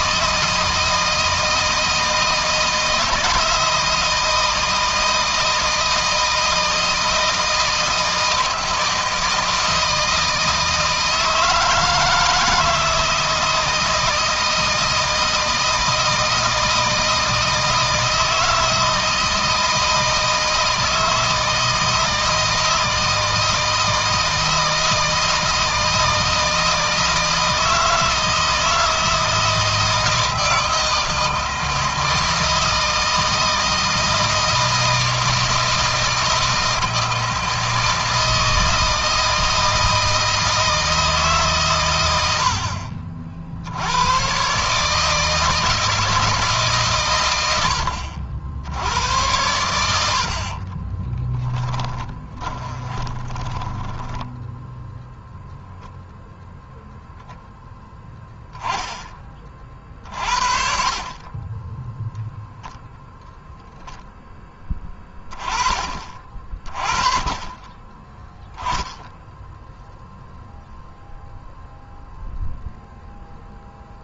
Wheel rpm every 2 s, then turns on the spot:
160, 160, 160, 160, 160, 160, 160, 160, 160, 160, 160, 160, 160, 160, 160, 160, 160, 160, 160, 160, 160, 50, 150, 140, 90, 30, 20, 0, 0, 20, 40, 0, 20, 30, 0, 0, 0.
50-54